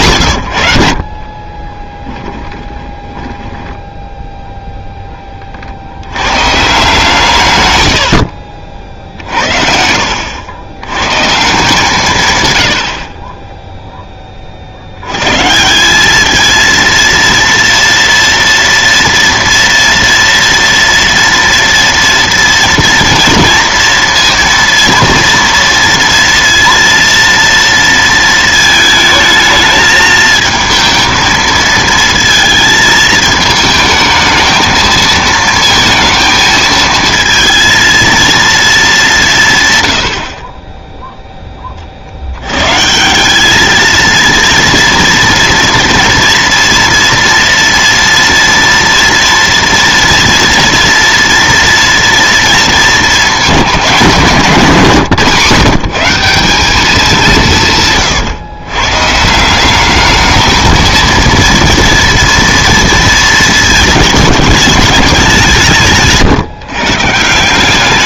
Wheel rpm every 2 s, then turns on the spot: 80, 10, 0, 140, 50, 70, 100, 60, 230, 230, 230, 230, 230, 230, 220, 220, 220, 220, 220, 220, 30, 120, 230, 230, 230, 230, 230, 200, 190, 120, 220, 230, 210, 140.
2-4 8-10 54-56